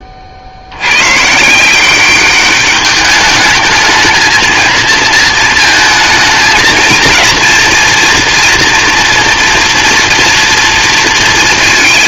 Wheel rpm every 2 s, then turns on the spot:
100, 200, 230, 230, 230, 230.
none